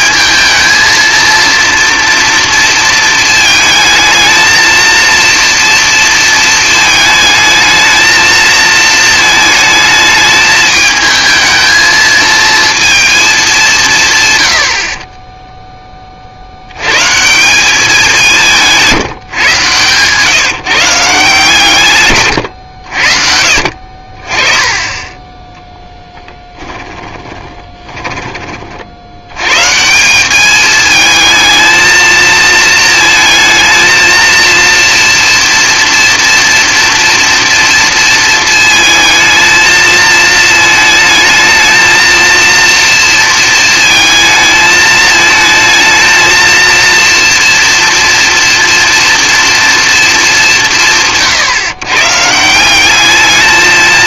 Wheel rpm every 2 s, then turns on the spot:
220, 230, 230, 220, 220, 220, 230, 50, 100, 170, 150, 100, 20, 10, 30, 210, 220, 230, 230, 220, 220, 230, 220, 230, 230, 200, 170.
26-28